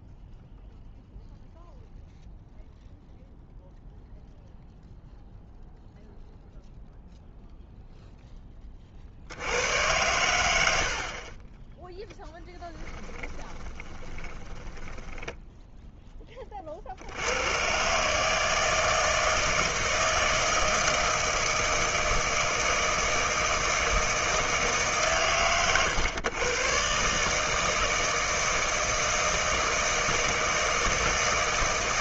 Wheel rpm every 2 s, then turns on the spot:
0, 0, 0, 0, 20, 90, 10, 10, 40, 160, 160, 160, 160, 120, 160, 160.
12-16